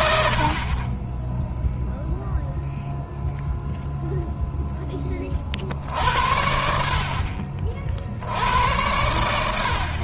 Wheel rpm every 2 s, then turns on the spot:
30, 0, 20, 50, 90.
none